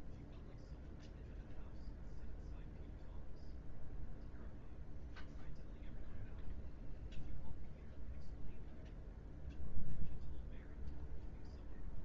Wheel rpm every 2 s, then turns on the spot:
0, 0, 0, 0, 0, 0.
none